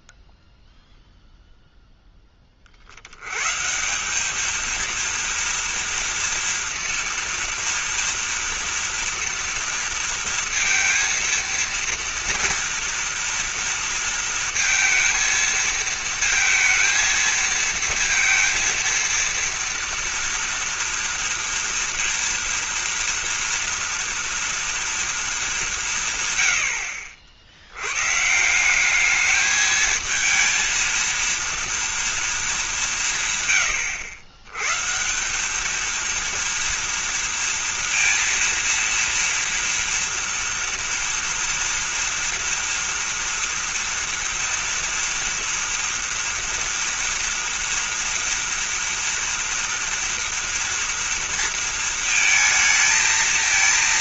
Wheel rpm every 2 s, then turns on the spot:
0, 60, 230, 230, 230, 230, 230, 220, 230, 230, 230, 230, 230, 70, 190, 230, 180, 140, 230, 230, 230, 230, 230, 230, 230, 230, 230.
none